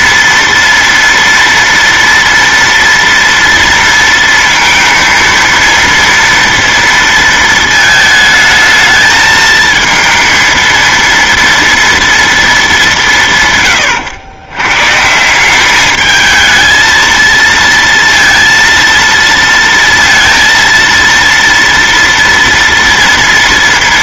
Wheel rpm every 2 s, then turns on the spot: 230, 230, 230, 230, 220, 230, 210, 120, 220, 230, 230, 230.
none